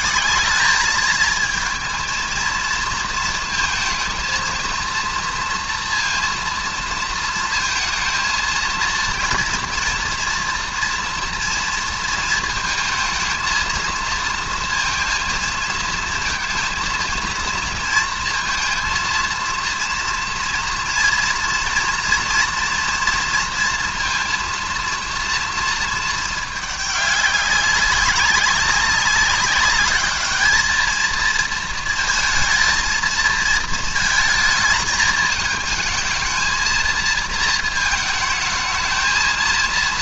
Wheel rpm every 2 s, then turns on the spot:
210, 230, 230, 230, 230, 230, 220, 230, 230, 230, 230, 240, 230, 210, 190, 210, 220, 220, 230, 220.
none